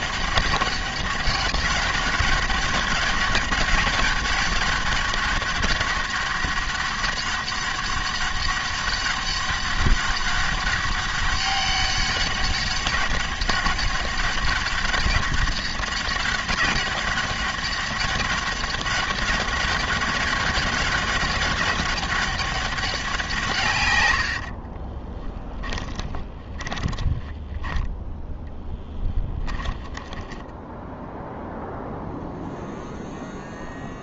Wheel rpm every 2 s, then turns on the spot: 200, 200, 200, 200, 200, 200, 200, 200, 200, 200, 200, 190, 20, 10, 10, 10, 0.
24-30